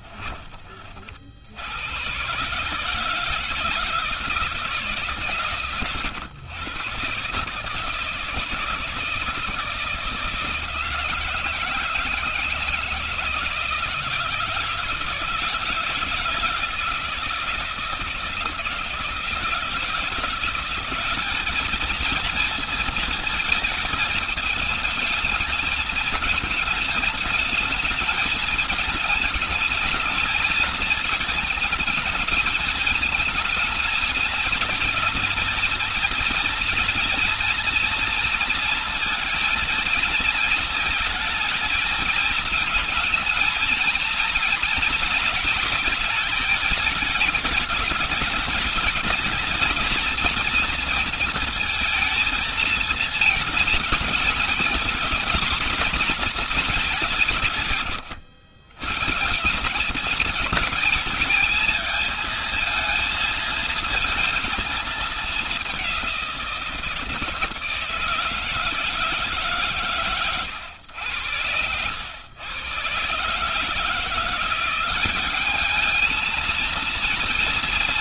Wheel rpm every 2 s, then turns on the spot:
30, 140, 160, 120, 160, 170, 160, 160, 160, 160, 170, 230, 220, 220, 220, 220, 220, 220, 230, 230, 220, 220, 230, 220, 210, 230, 230, 230, 220, 110, 220, 220, 220, 180, 160, 110, 110, 180, 220.
none